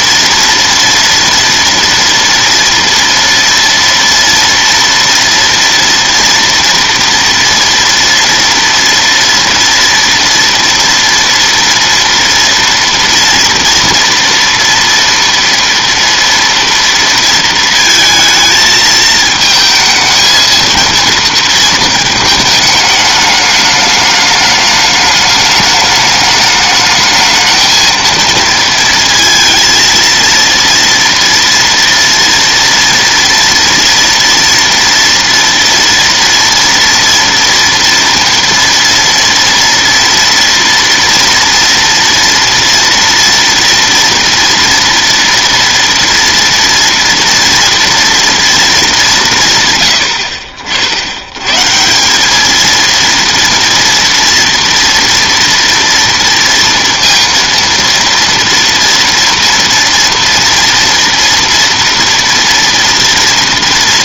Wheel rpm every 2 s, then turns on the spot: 230, 230, 230, 230, 230, 230, 230, 230, 230, 220, 230, 220, 210, 210, 230, 230, 230, 240, 230, 230, 230, 230, 240, 230, 210, 60, 220, 230, 230, 230, 240, 230.
none